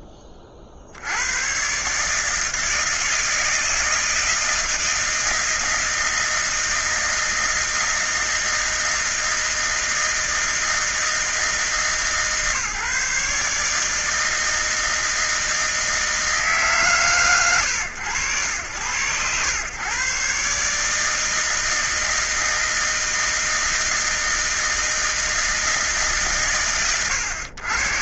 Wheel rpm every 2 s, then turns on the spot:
30, 160, 160, 160, 160, 160, 150, 160, 160, 80, 140, 160, 160, 130.
none